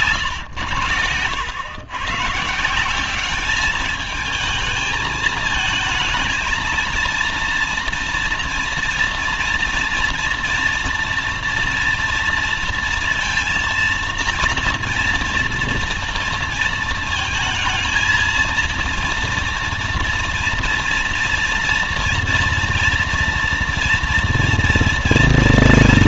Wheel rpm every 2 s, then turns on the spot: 110, 150, 210, 220, 230, 230, 230, 230, 230, 230, 230, 230, 230.
none